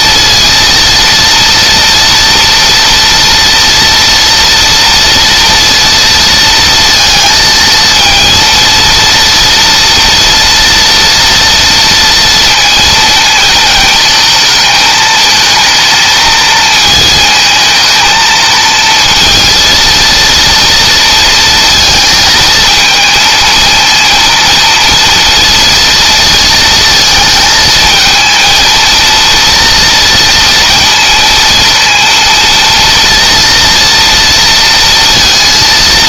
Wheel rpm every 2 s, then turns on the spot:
230, 230, 230, 230, 230, 240, 230, 220, 220, 230, 230, 220, 230, 220, 230, 230, 230, 230.
none